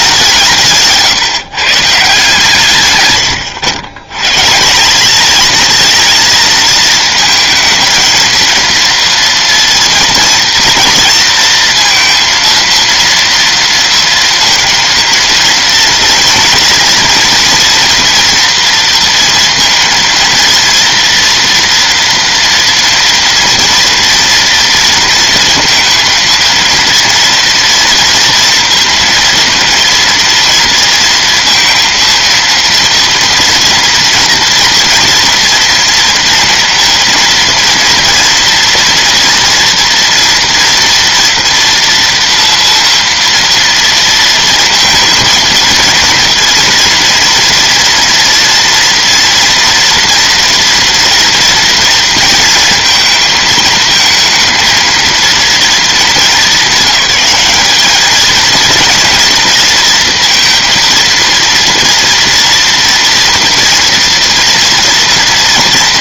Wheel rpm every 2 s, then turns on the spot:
160, 140, 150, 230, 230, 230, 230, 230, 230, 230, 230, 240, 230, 230, 230, 230, 230, 230, 230, 240, 230, 230, 230, 230, 230, 230, 230, 230, 200, 230, 230, 240, 230.
none